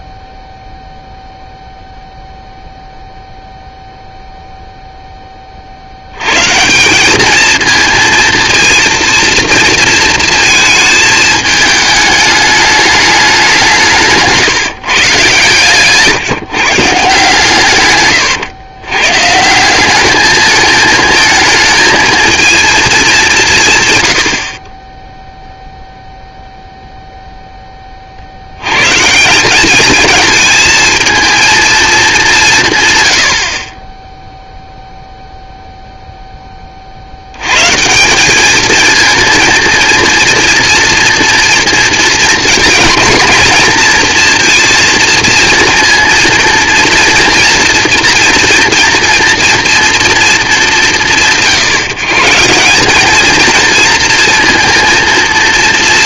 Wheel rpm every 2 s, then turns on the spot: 0, 0, 0, 170, 230, 220, 210, 160, 150, 120, 220, 220, 20, 0, 80, 220, 170, 0, 10, 200, 230, 220, 230, 230, 230, 220, 160, 240.
none